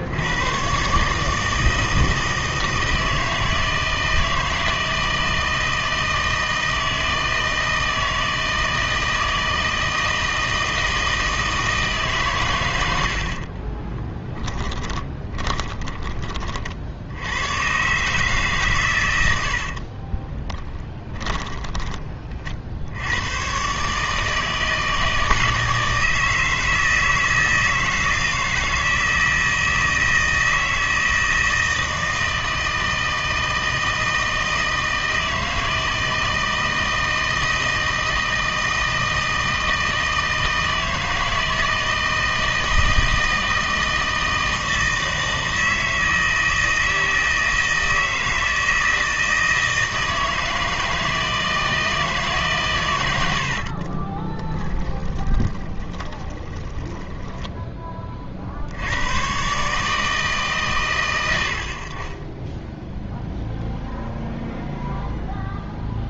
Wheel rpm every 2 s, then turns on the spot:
120, 160, 160, 160, 160, 160, 110, 10, 50, 130, 10, 60, 160, 160, 160, 160, 160, 160, 160, 160, 160, 160, 160, 160, 160, 160, 130, 20, 20, 70, 130, 10, 0.
14-16 20-22 54-58